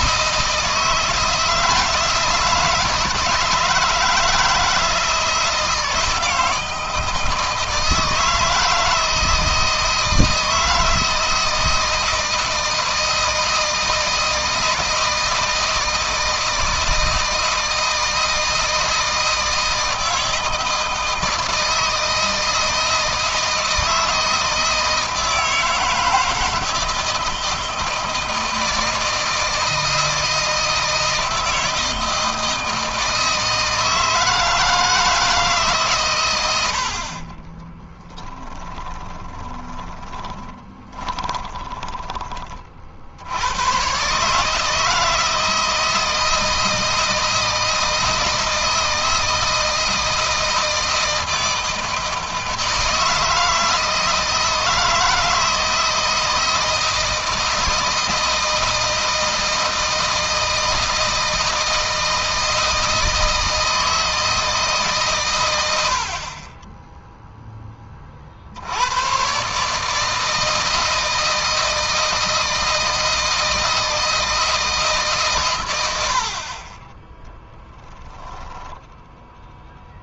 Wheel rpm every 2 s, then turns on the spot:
160, 160, 160, 160, 160, 160, 160, 160, 160, 160, 160, 160, 160, 160, 160, 160, 160, 160, 80, 20, 20, 40, 160, 160, 160, 160, 160, 160, 160, 160, 160, 160, 150, 10, 90, 160, 160, 160, 30, 10.
38-42